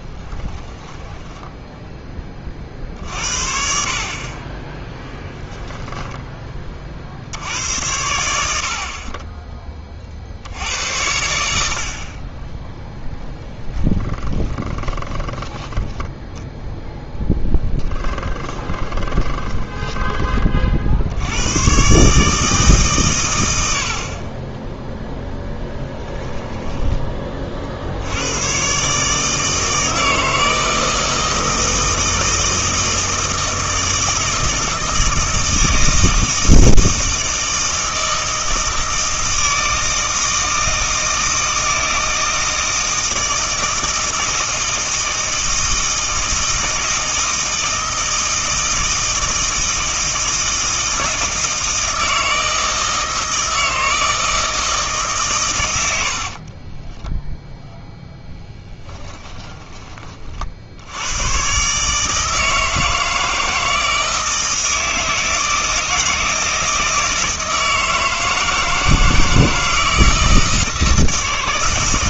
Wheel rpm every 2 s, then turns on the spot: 10, 50, 10, 30, 70, 80, 10, 20, 0, 20, 60, 140, 0, 10, 140, 160, 160, 160, 160, 160, 160, 160, 160, 160, 160, 160, 160, 160, 20, 10, 70, 160, 160, 160, 160, 160.
0-2 4-6 12-16 18-20 56-60